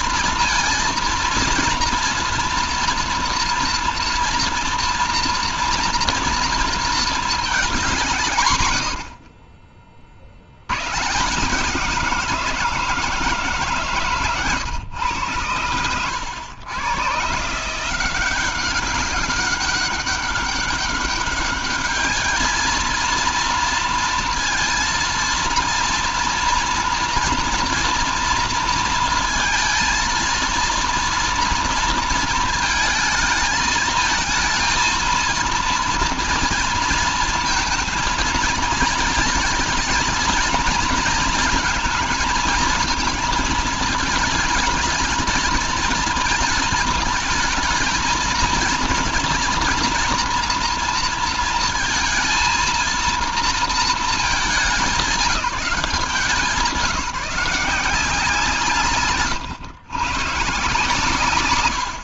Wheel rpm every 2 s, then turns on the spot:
230, 230, 230, 230, 130, 90, 170, 140, 110, 190, 200, 220, 230, 230, 230, 230, 220, 220, 230, 230, 230, 230, 220, 220, 230, 230, 230, 200, 170, 150, 140.
none